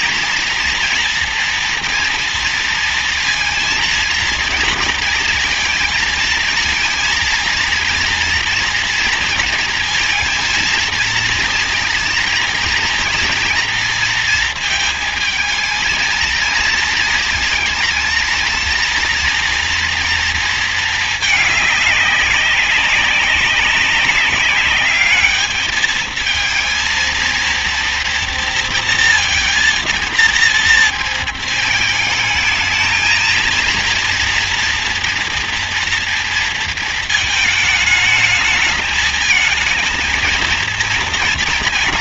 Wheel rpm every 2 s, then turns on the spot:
230, 230, 230, 230, 230, 230, 230, 230, 230, 230, 220, 200, 200, 220, 230, 230, 220, 230, 230, 220, 230.
none